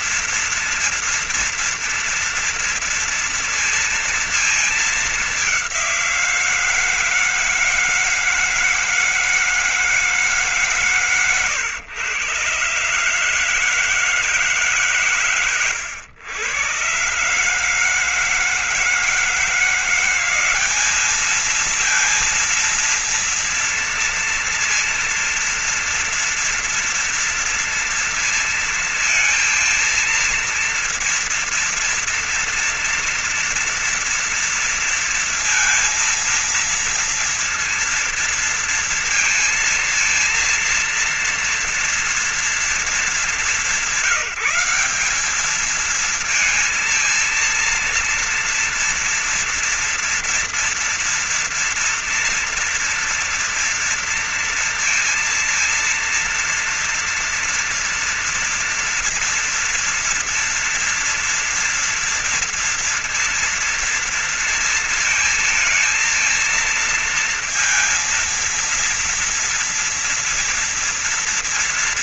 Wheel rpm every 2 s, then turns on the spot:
230, 230, 230, 180, 160, 160, 130, 160, 120, 160, 180, 230, 230, 230, 230, 230, 230, 230, 230, 230, 230, 230, 190, 220, 230, 230, 240, 230, 230, 230, 240, 230, 230, 230, 230, 230.
none